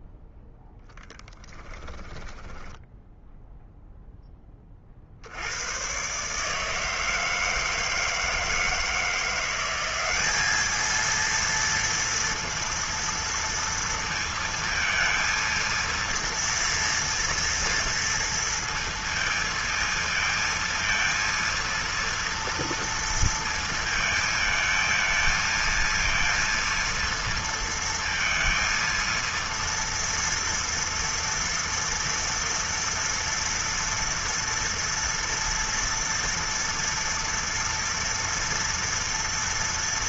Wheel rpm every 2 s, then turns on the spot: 0, 10, 20, 150, 160, 210, 230, 230, 230, 230, 230, 230, 220, 230, 230, 230, 230, 230, 230, 230.
2-4